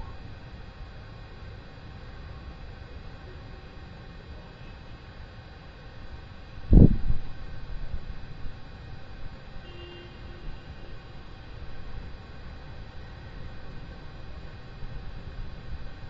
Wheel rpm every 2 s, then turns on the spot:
0, 0, 0, 0, 0, 0, 0, 0.
none